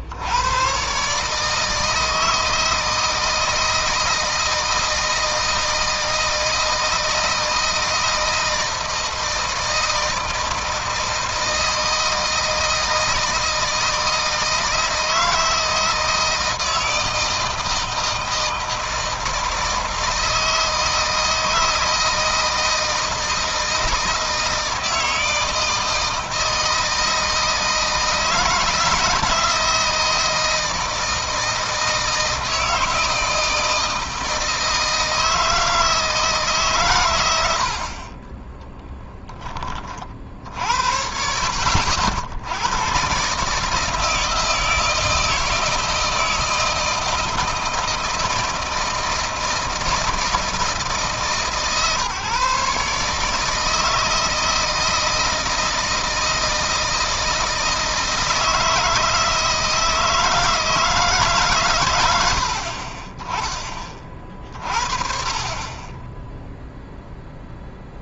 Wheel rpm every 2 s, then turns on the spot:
120, 160, 160, 160, 160, 160, 160, 160, 160, 160, 160, 160, 160, 160, 170, 160, 160, 160, 120, 10, 70, 100, 160, 160, 160, 160, 150, 170, 160, 160, 160, 40, 40, 0.
38-40